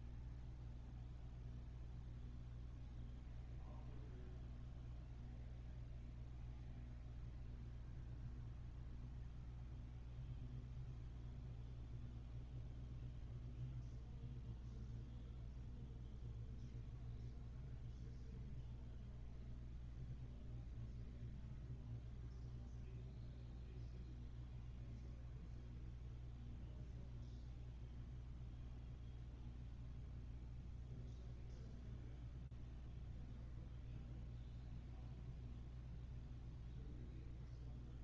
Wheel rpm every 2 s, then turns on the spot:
0, 0, 0, 0, 0, 0, 0, 0, 0, 0, 0, 0, 0, 0, 0, 0, 0, 0, 0.
none